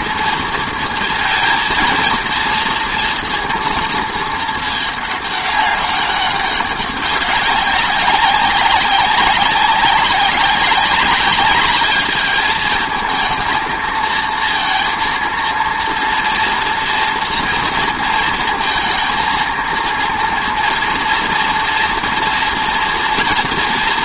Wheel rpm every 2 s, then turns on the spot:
230, 230, 210, 200, 190, 190, 210, 230, 230, 230, 230, 230.
none